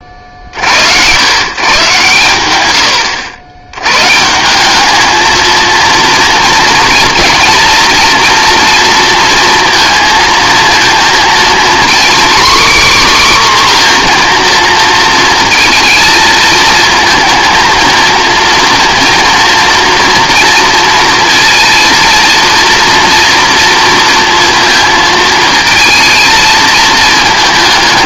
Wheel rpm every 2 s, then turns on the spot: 80, 80, 210, 230, 230, 230, 280, 230, 220, 230, 230, 230, 230, 220.
none